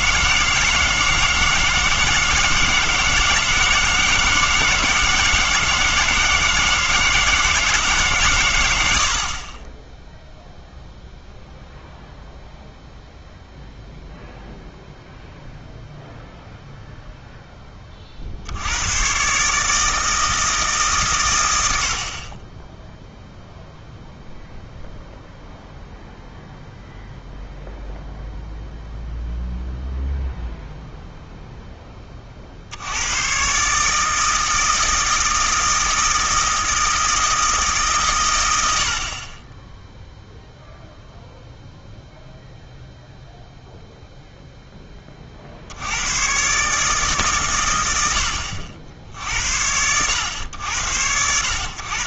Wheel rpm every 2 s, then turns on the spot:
160, 160, 160, 160, 90, 0, 0, 0, 0, 90, 150, 10, 0, 0, 0, 0, 60, 160, 160, 90, 0, 0, 10, 140, 70, 80.
none